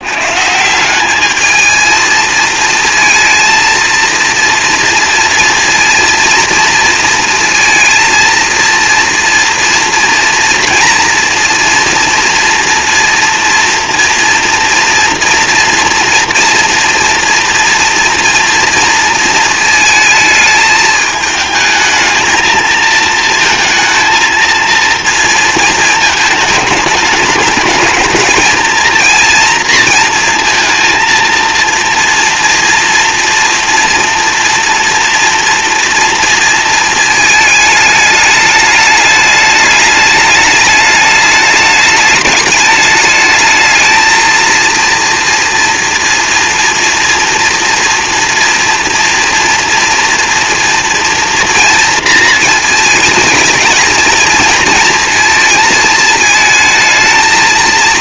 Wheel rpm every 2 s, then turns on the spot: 170, 220, 230, 230, 230, 230, 230, 230, 230, 230, 210, 220, 230, 210, 230, 230, 230, 230, 220, 210, 210, 210, 230, 230, 230, 230, 220, 230, 220.
none